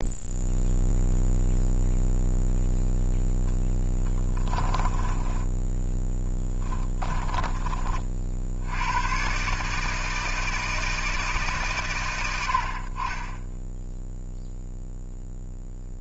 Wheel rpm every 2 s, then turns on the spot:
0, 0, 10, 20, 80, 160, 70, 0.
4-8